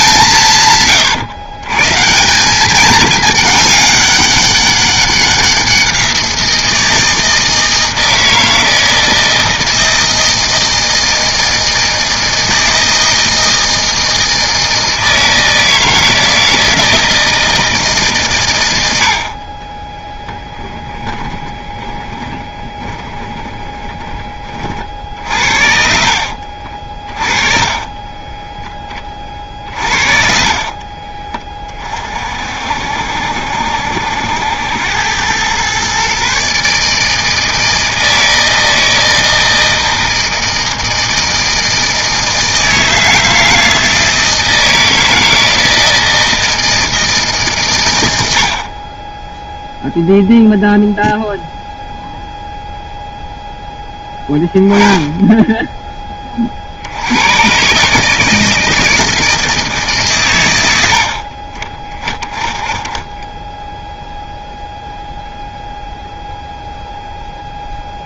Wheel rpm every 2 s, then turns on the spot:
150, 190, 200, 170, 160, 160, 160, 160, 160, 110, 10, 20, 30, 50, 10, 40, 50, 80, 150, 160, 160, 160, 160, 160, 60, 0, 0, 10, 40, 160, 100, 20, 0, 0.
20-24 26-28 30-32